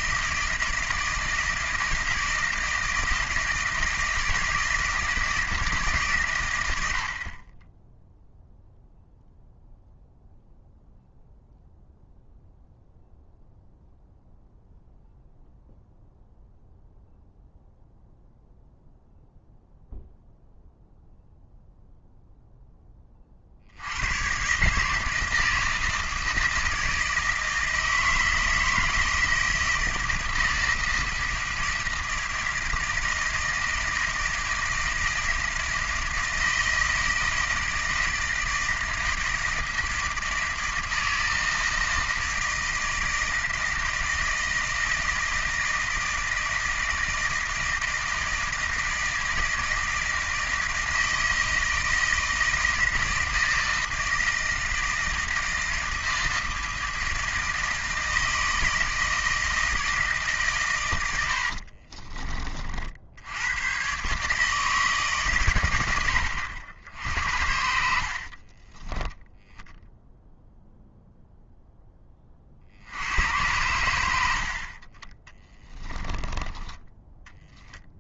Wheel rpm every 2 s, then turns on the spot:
160, 170, 160, 110, 0, 0, 0, 0, 0, 0, 0, 0, 140, 160, 170, 160, 160, 160, 160, 160, 160, 160, 160, 160, 160, 160, 160, 160, 160, 160, 120, 40, 150, 80, 30, 0, 60, 60, 20.
68-70 74-78